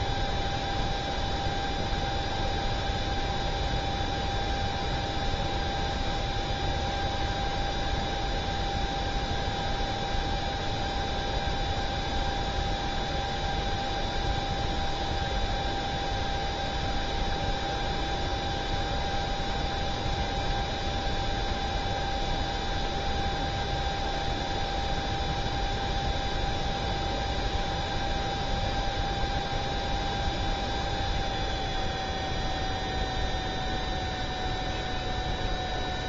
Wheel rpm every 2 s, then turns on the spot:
0, 0, 0, 0, 0, 0, 0, 0, 0, 0, 0, 0, 0, 0, 0, 0, 0, 0.
none